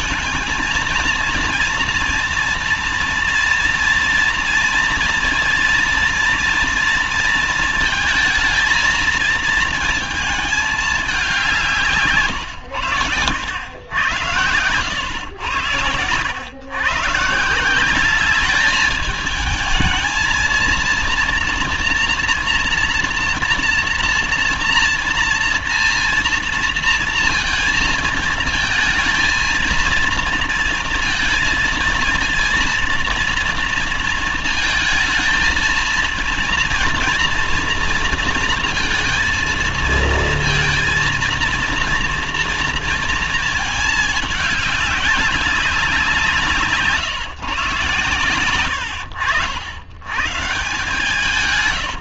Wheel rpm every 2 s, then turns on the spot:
220, 230, 230, 230, 220, 210, 110, 100, 120, 210, 230, 230, 230, 230, 220, 230, 230, 220, 230, 230, 230, 230, 210, 150, 100, 160.
48-50